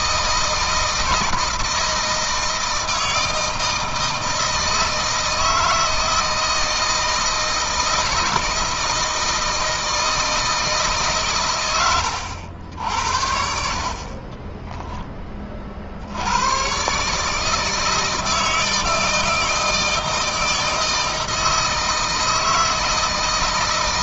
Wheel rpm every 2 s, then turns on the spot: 160, 160, 160, 160, 160, 160, 80, 20, 110, 160, 160, 160.
14-16